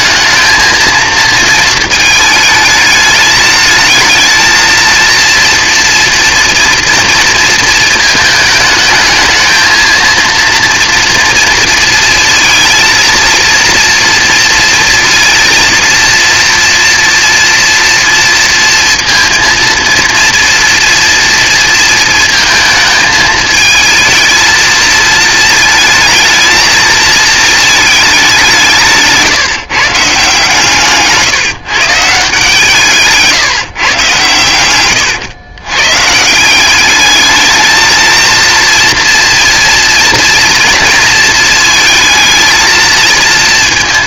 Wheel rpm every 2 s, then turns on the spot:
220, 220, 220, 230, 210, 230, 230, 230, 240, 230, 240, 230, 220, 220, 160, 150, 160, 110, 180, 230, 230, 230.
none